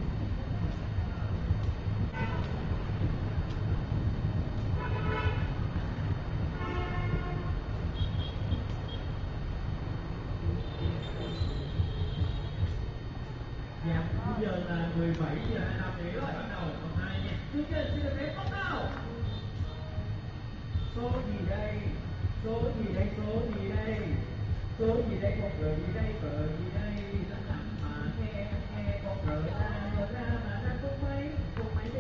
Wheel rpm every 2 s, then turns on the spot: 0, 0, 0, 0, 0, 0, 0, 0, 0, 0, 0, 0, 0, 0, 0, 0.
none